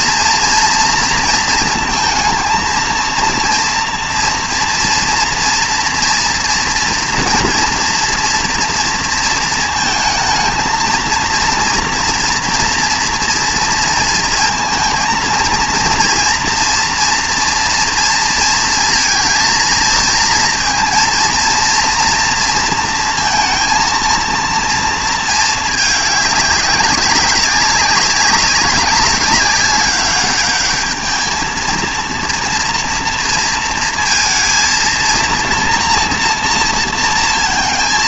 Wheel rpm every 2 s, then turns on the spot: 230, 230, 230, 240, 240, 230, 230, 230, 240, 220, 230, 230, 230, 200, 190, 210, 230, 230, 230.
none